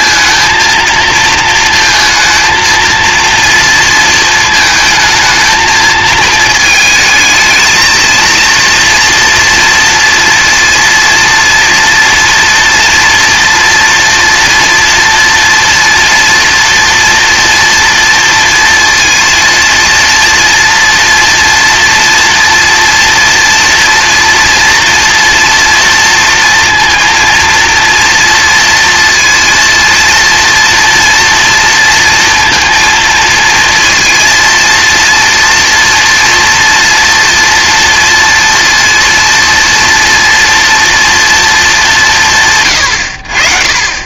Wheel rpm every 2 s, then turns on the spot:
230, 230, 220, 220, 230, 230, 230, 230, 230, 230, 230, 230, 230, 230, 230, 230, 230, 230, 230, 230, 230, 80.
none